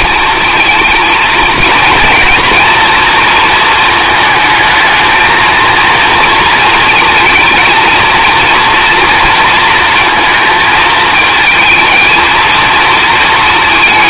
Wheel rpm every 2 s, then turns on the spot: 230, 230, 220, 220, 230, 220, 230.
none